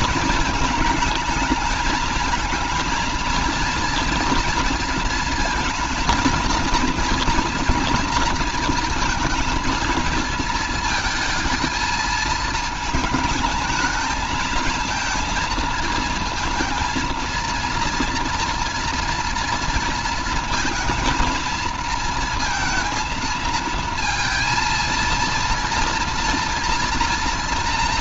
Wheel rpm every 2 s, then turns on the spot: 220, 220, 230, 230, 230, 220, 220, 220, 230, 230, 230, 230, 230, 230.
none